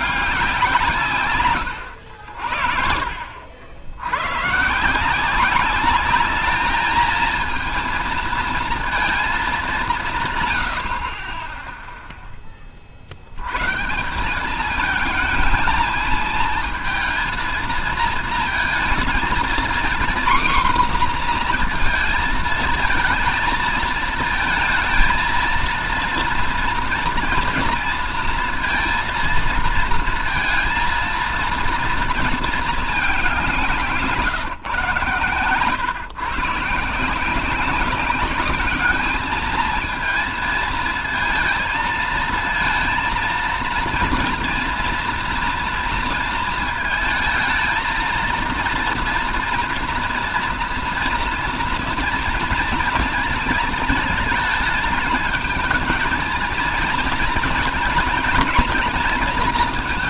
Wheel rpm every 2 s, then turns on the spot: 180, 60, 140, 220, 220, 90, 30, 200, 220, 220, 240, 220, 230, 230, 230, 230, 220, 130, 140, 210, 220, 230, 230, 230, 230, 230, 230, 220, 230, 230.
none